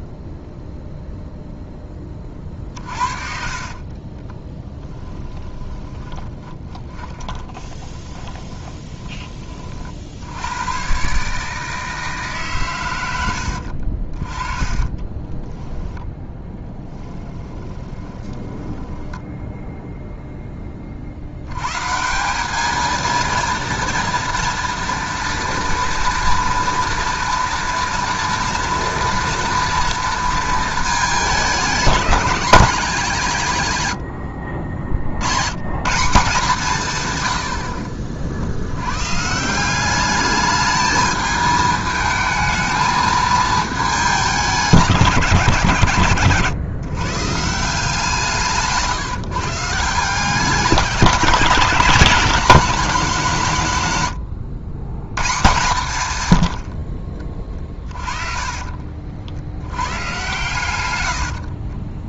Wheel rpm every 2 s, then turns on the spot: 0, 40, 10, 20, 30, 120, 110, 20, 10, 20, 30, 220, 230, 230, 230, 220, 200, 60, 140, 100, 210, 220, 180, 140, 150, 190, 210, 110, 50, 50, 120.
2-10 14-20 60-62